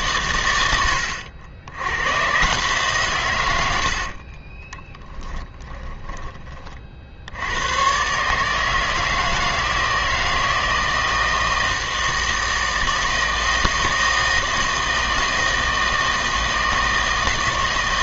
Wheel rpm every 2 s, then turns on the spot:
90, 140, 20, 30, 160, 160, 160, 160, 160.
4-6